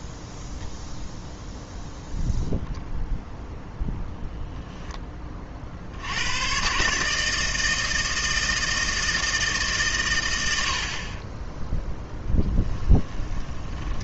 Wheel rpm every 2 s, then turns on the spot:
0, 0, 10, 130, 160, 60, 10.
12-14